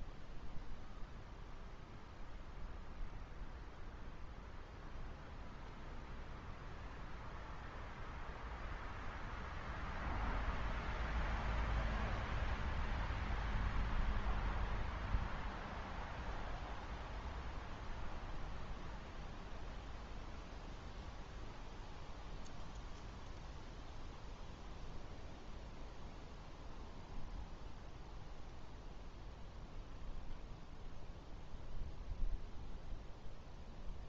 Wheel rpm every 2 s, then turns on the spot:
0, 0, 0, 0, 0, 0, 0, 0, 0, 0, 0, 0, 0, 0, 0, 0, 0.
none